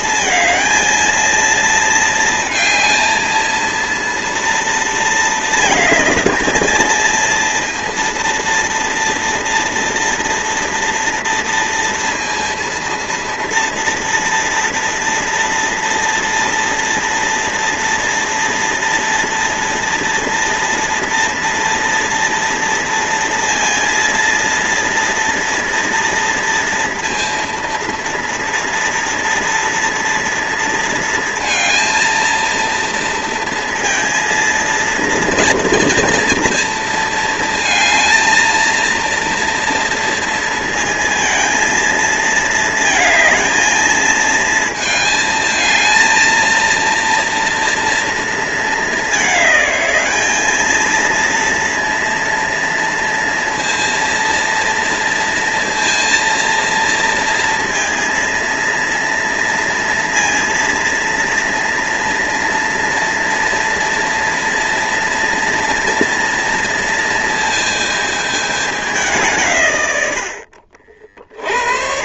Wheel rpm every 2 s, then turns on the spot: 230, 230, 220, 230, 230, 230, 230, 230, 230, 230, 240, 230, 230, 230, 230, 230, 230, 230, 220, 230, 230, 220, 220, 230, 210, 230, 230, 230, 230, 230, 230, 230, 240, 230, 160, 40.
none